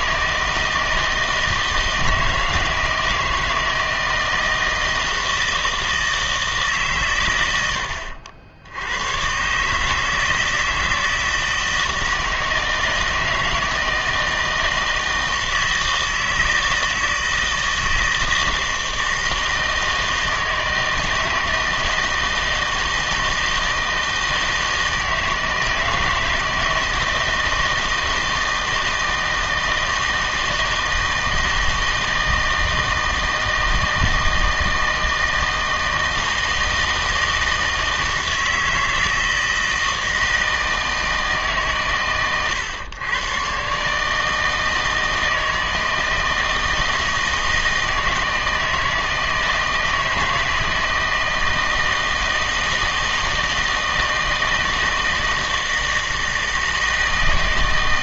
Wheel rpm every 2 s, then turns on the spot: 160, 160, 160, 140, 90, 160, 160, 160, 160, 160, 160, 160, 160, 160, 160, 160, 160, 160, 160, 160, 160, 110, 160, 160, 160, 160, 160, 160, 160.
none